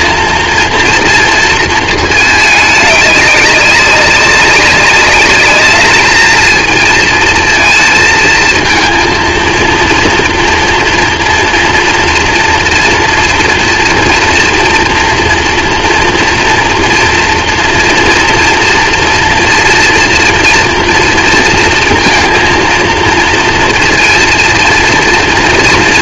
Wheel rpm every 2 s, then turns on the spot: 230, 210, 200, 220, 220, 230, 230, 230, 230, 230, 230, 230, 230.
none